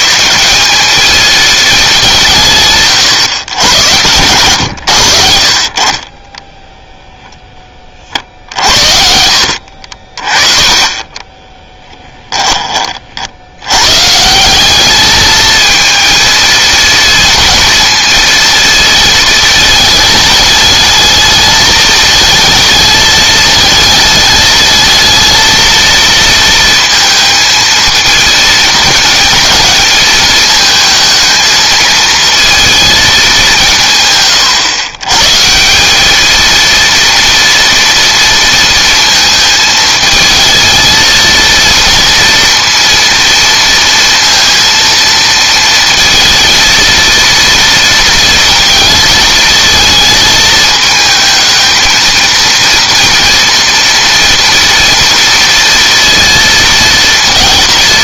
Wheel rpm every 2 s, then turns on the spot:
200, 140, 90, 0, 60, 30, 30, 200, 220, 230, 220, 220, 220, 230, 220, 220, 220, 120, 230, 230, 220, 230, 230, 230, 230, 220, 230, 240, 230.
none